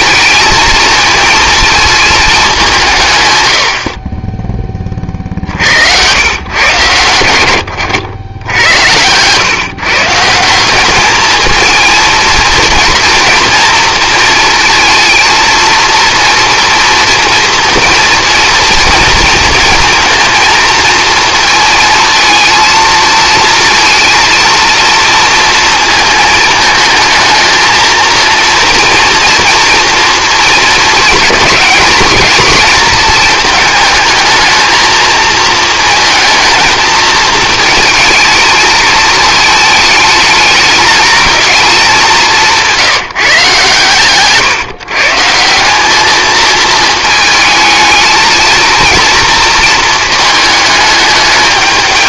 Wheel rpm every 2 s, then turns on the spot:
230, 180, 30, 120, 90, 190, 230, 230, 230, 230, 230, 230, 230, 230, 240, 230, 220, 220, 220, 220, 210, 170, 150, 220, 230, 220.
8-10